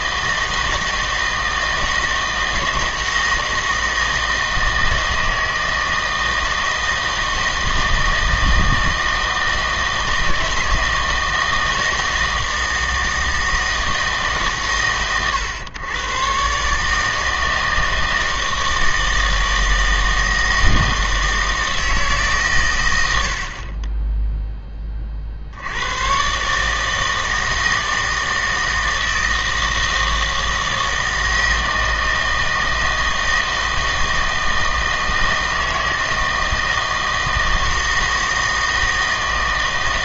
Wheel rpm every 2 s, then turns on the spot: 160, 160, 160, 160, 160, 160, 160, 140, 140, 160, 160, 120, 10, 150, 160, 160, 160, 160, 160, 160.
none